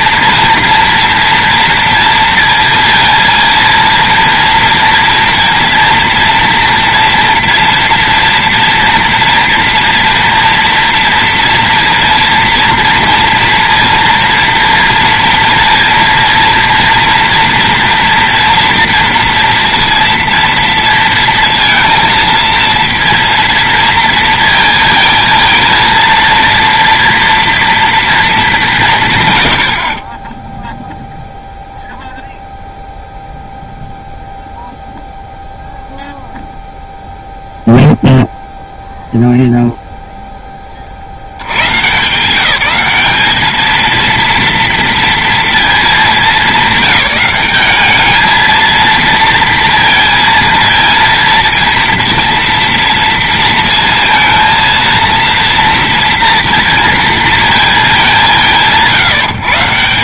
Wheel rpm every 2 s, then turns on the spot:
230, 230, 230, 230, 240, 230, 230, 230, 230, 230, 230, 230, 230, 230, 190, 0, 0, 0, 0, 0, 20, 190, 230, 200, 220, 230, 230, 230, 230, 170.
none